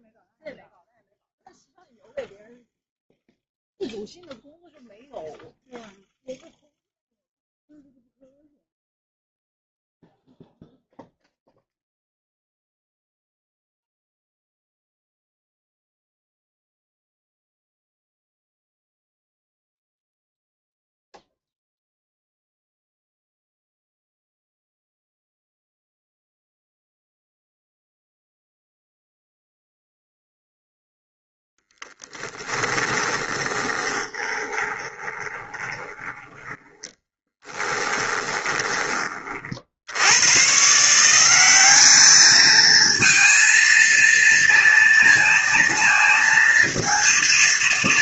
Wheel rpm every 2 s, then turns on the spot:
0, 0, 0, 0, 0, 0, 0, 0, 0, 0, 0, 0, 0, 0, 0, 0, 10, 20, 10, 20, 140, 220, 230, 230.
32-40